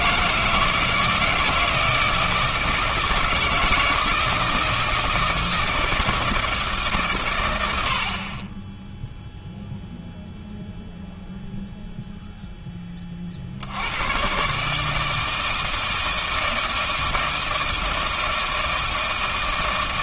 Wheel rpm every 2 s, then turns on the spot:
160, 160, 160, 150, 10, 0, 10, 150, 160, 160.
none